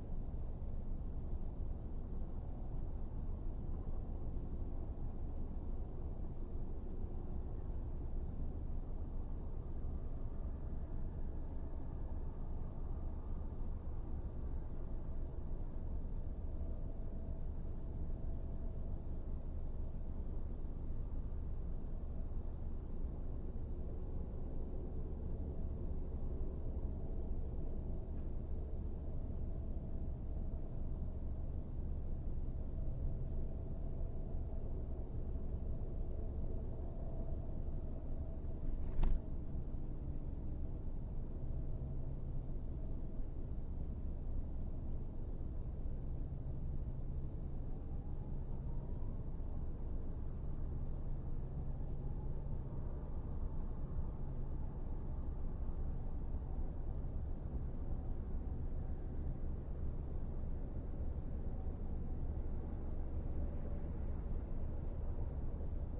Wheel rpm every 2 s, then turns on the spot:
0, 0, 0, 0, 0, 0, 0, 0, 0, 0, 0, 0, 0, 0, 0, 0, 0, 0, 0, 0, 0, 0, 0, 0, 0, 0, 0, 0, 0, 0, 0, 0, 0.
none